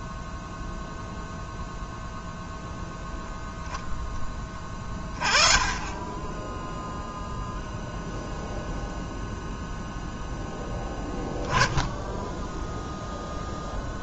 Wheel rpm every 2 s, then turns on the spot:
0, 0, 20, 10, 0, 10, 0.
none